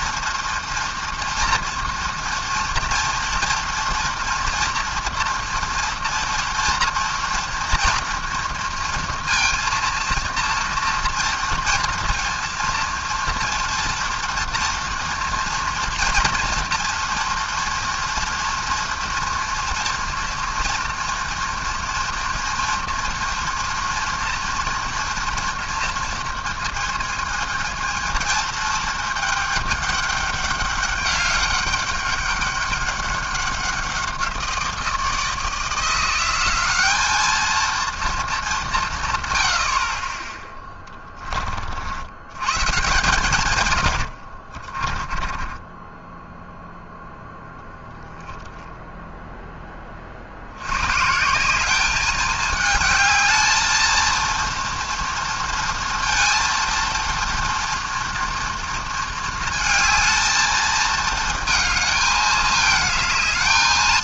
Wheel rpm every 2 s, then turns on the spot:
230, 230, 230, 240, 230, 230, 230, 230, 230, 230, 230, 230, 230, 230, 220, 200, 200, 170, 190, 190, 10, 130, 50, 0, 10, 90, 210, 230, 230, 230, 220, 210.
40-42 44-46